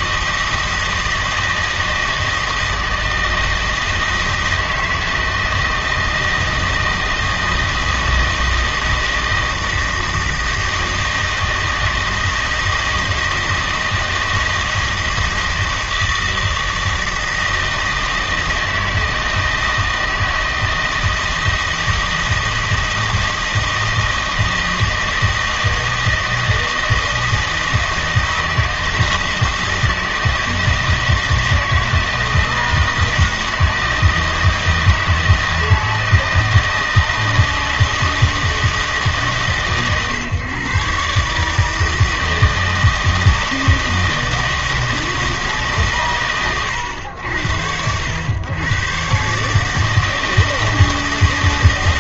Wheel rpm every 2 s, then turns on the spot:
160, 160, 160, 160, 160, 160, 160, 160, 160, 160, 160, 160, 160, 160, 160, 160, 160, 160, 160, 160, 130, 160, 160, 110, 120, 160.
none